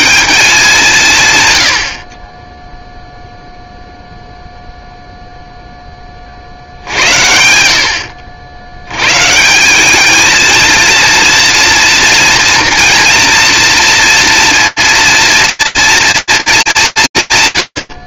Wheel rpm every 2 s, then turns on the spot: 170, 30, 0, 60, 90, 230, 230, 230, 220.
none